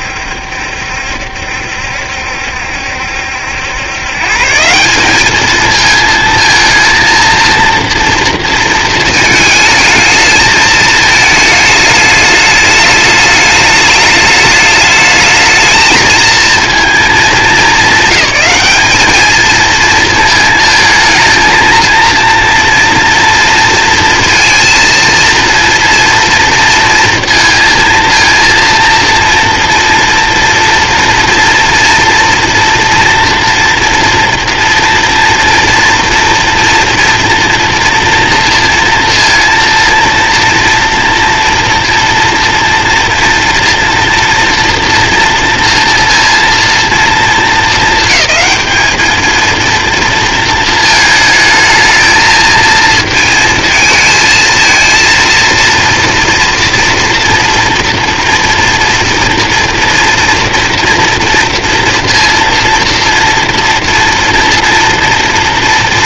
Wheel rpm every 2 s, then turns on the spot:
70, 70, 160, 230, 230, 220, 210, 210, 230, 200, 220, 230, 230, 230, 230, 230, 230, 230, 240, 230, 240, 240, 230, 230, 210, 220, 220, 230, 230, 230, 230, 230, 230.
none